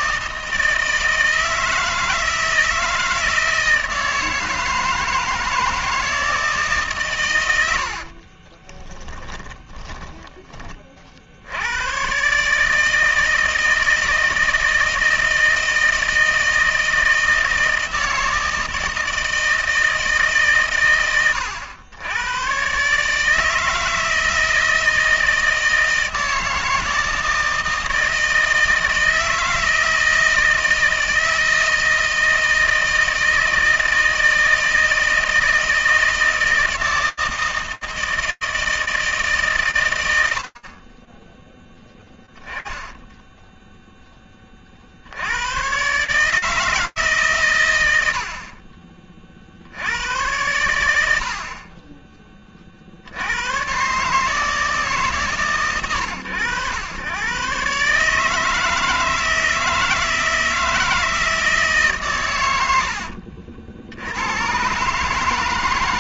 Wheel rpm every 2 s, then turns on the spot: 160, 160, 160, 120, 20, 50, 160, 160, 160, 160, 90, 160, 160, 160, 160, 160, 160, 160, 160, 160, 20, 10, 60, 160, 50, 90, 80, 140, 110, 160, 160, 80, 150.
8-10 42-44 48-50 62-64